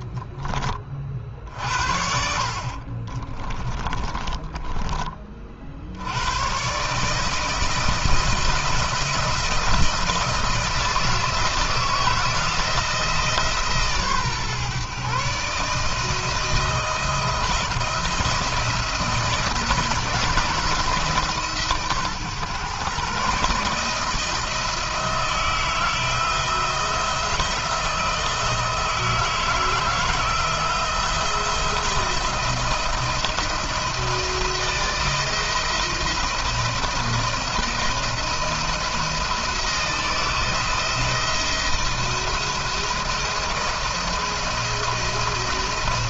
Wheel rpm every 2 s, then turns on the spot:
30, 50, 30, 130, 170, 170, 160, 130, 160, 160, 160, 140, 160, 170, 160, 170, 170, 170, 170, 160, 170, 170, 170.
2-6